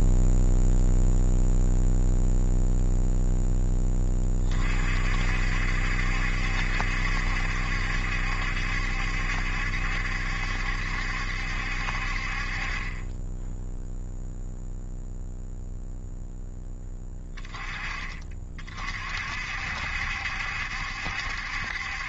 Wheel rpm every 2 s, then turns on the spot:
0, 0, 40, 70, 70, 70, 30, 0, 20, 40, 70.
none